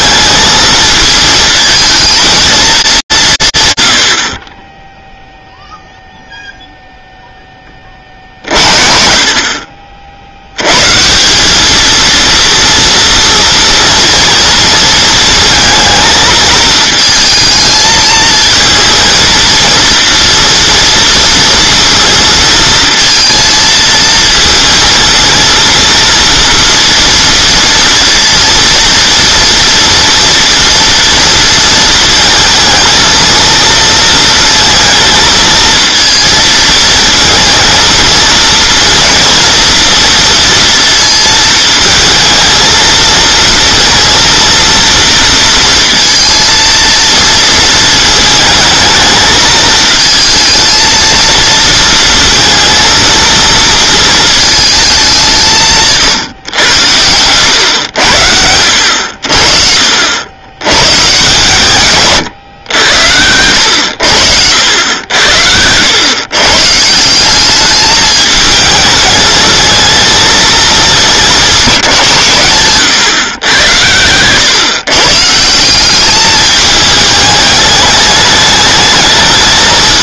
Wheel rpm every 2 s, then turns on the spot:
220, 200, 10, 0, 50, 150, 230, 230, 220, 230, 230, 230, 230, 230, 230, 240, 230, 220, 220, 230, 230, 230, 230, 230, 220, 230, 230, 200, 100, 80, 120, 90, 80, 160, 220, 210, 120, 140, 210, 210.
none